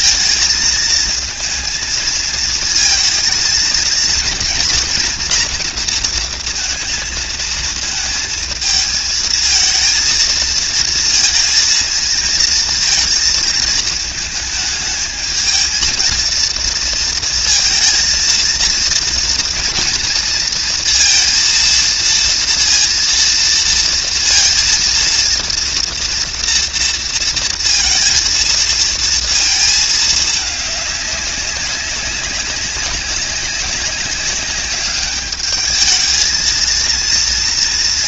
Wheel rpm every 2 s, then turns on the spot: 230, 220, 230, 230, 230, 230, 230, 220, 230, 230, 230, 230, 230, 230, 230, 220, 200, 200, 220.
none